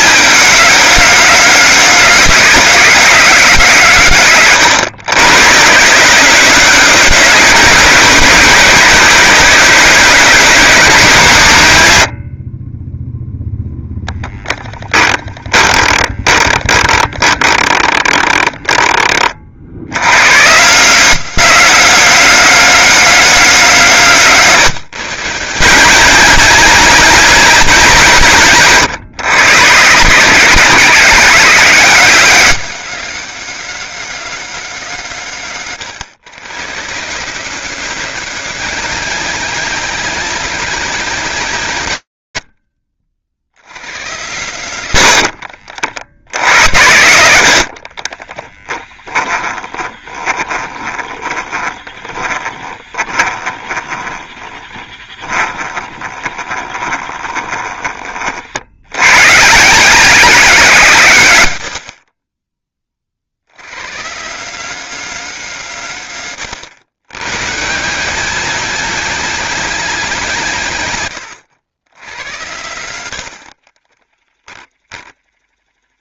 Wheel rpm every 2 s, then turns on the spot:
220, 210, 140, 200, 210, 210, 30, 10, 20, 20, 160, 210, 160, 210, 150, 200, 210, 190, 140, 200, 210, 70, 80, 90, 20, 20, 20, 20, 20, 110, 130, 50, 200, 120, 210, 120, 110, 20.
14-20 44-46 48-58 74-76